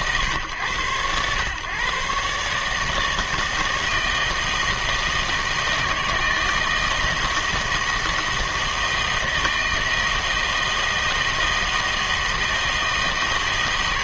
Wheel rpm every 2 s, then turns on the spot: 120, 150, 160, 160, 160, 160, 160.
none